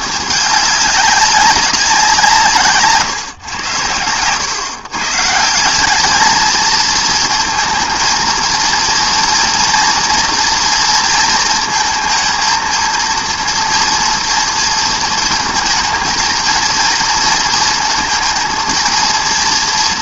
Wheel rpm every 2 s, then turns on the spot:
210, 160, 120, 220, 230, 230, 230, 230, 220, 220.
none